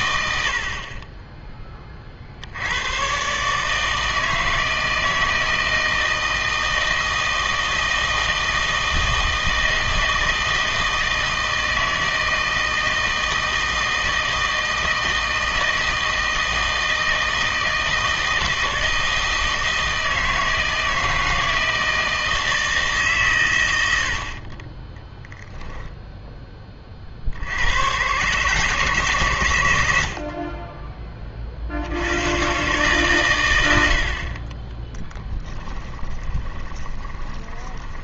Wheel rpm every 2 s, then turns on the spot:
60, 80, 160, 160, 160, 160, 160, 160, 160, 160, 160, 160, 20, 20, 150, 30, 130, 20, 20.
0-2 34-38